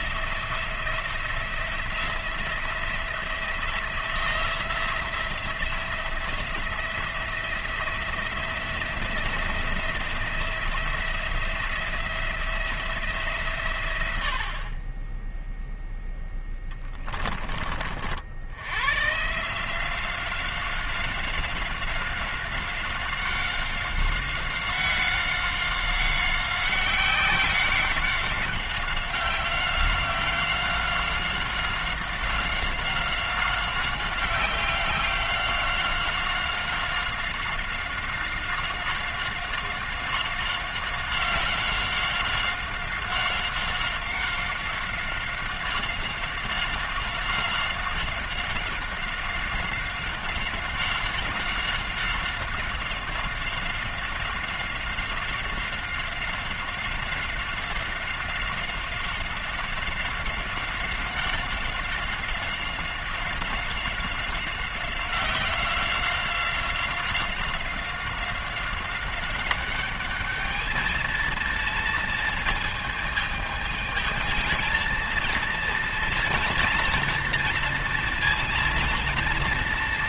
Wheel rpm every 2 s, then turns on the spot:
170, 170, 170, 170, 170, 170, 170, 40, 20, 110, 190, 190, 190, 190, 190, 190, 190, 190, 190, 190, 190, 190, 190, 190, 190, 190, 190, 190, 190, 190, 190, 190, 190, 180, 190, 220, 220, 230, 230, 230.
none